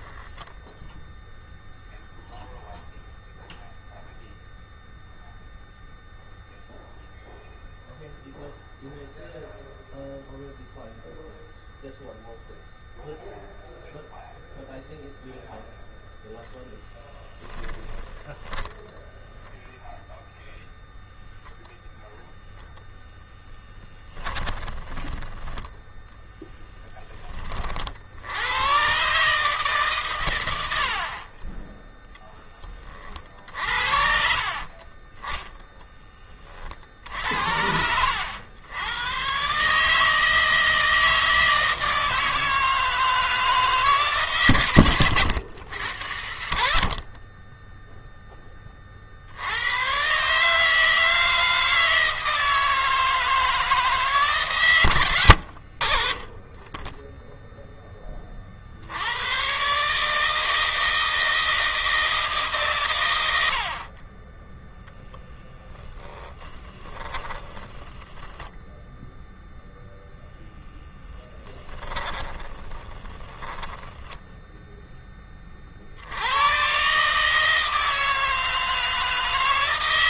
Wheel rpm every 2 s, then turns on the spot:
20, 0, 0, 0, 0, 0, 0, 0, 0, 0, 0, 0, 10, 0, 80, 100, 30, 40, 40, 90, 160, 160, 130, 60, 20, 150, 160, 130, 20, 60, 160, 140, 10, 10, 10, 0, 20, 10, 110, 160.
0-2 34-36 66-68 72-74